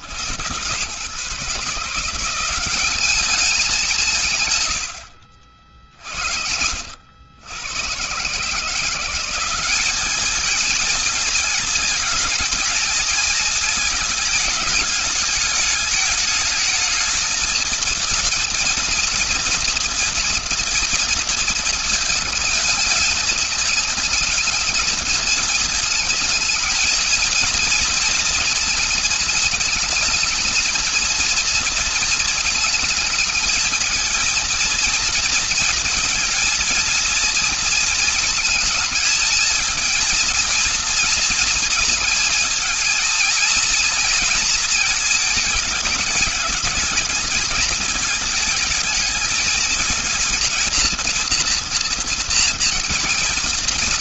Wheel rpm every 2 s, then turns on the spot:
90, 180, 130, 60, 140, 210, 220, 220, 210, 230, 230, 220, 220, 220, 230, 220, 230, 230, 230, 230, 230, 220, 230, 210, 220, 230, 240.
none